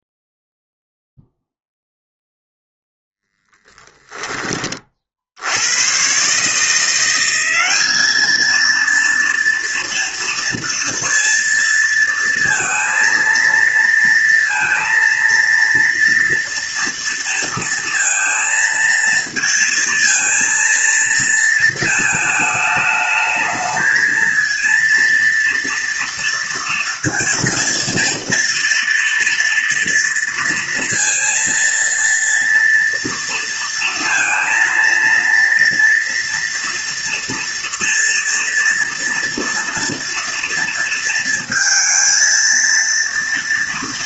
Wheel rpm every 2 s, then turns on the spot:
0, 0, 30, 160, 230, 230, 230, 230, 230, 230, 230, 210, 230, 230, 230, 230, 230, 230, 240, 240, 230, 230.
none